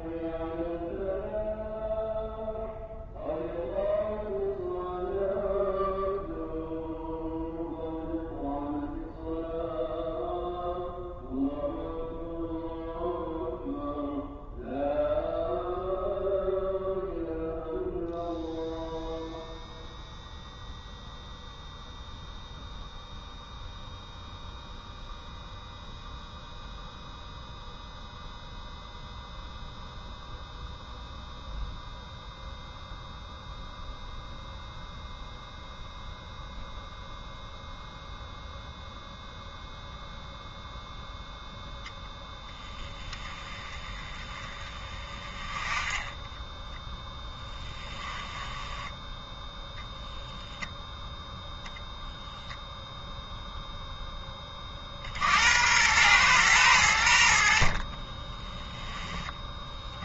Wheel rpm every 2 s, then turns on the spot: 0, 0, 0, 0, 0, 0, 0, 0, 0, 0, 0, 0, 0, 0, 0, 0, 0, 0, 0, 0, 0, 10, 20, 10, 10, 0, 0, 10, 110, 30.
48-50 58-60